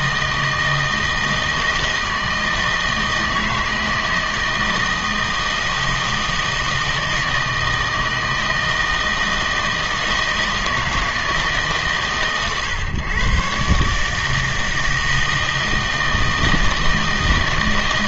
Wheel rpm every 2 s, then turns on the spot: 160, 160, 160, 160, 160, 160, 130, 160, 160.
none